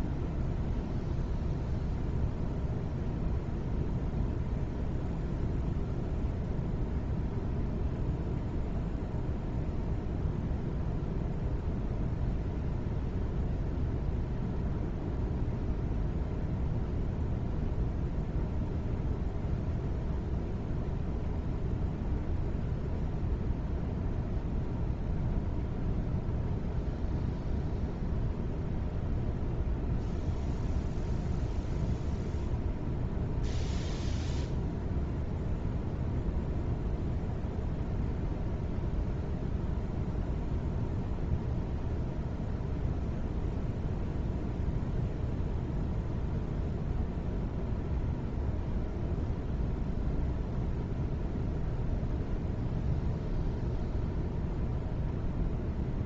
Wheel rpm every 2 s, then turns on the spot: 0, 0, 0, 0, 0, 0, 0, 0, 0, 0, 0, 0, 0, 0, 0, 0, 0, 0, 0, 0, 0, 0, 0, 0, 0, 0, 0, 0.
none